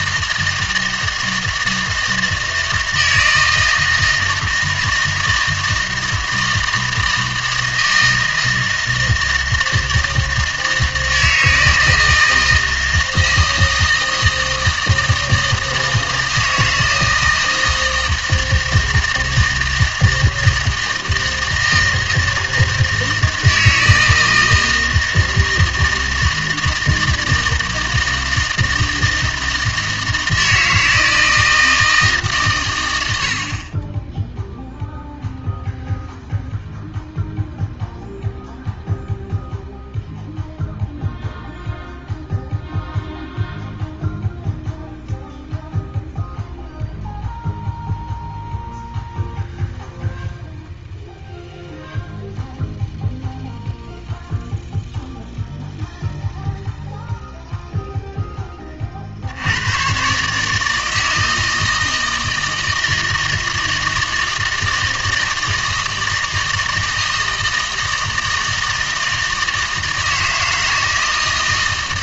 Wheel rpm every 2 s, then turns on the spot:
160, 160, 160, 160, 160, 160, 160, 160, 160, 160, 160, 160, 160, 160, 160, 160, 110, 0, 0, 0, 0, 0, 0, 0, 0, 0, 0, 0, 0, 30, 160, 160, 160, 160, 160, 160.
none